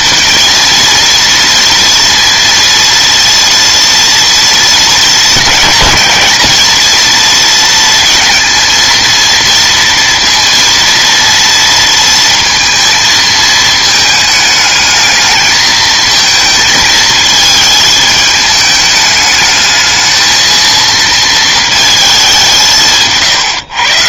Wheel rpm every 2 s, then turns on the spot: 230, 230, 220, 220, 230, 230, 230, 210, 230, 210, 220, 170.
none